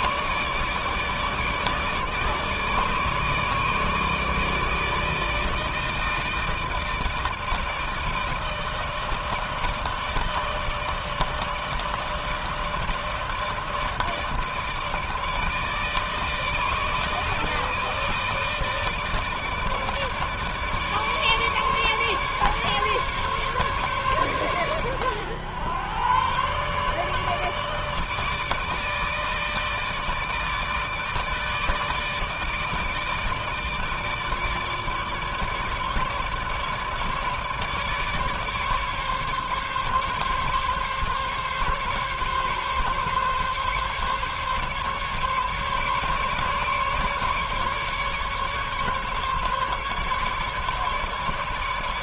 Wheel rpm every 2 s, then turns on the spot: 150, 150, 160, 160, 160, 160, 160, 160, 160, 160, 150, 140, 110, 140, 150, 160, 150, 150, 150, 150, 140, 140, 140, 150, 140, 150.
none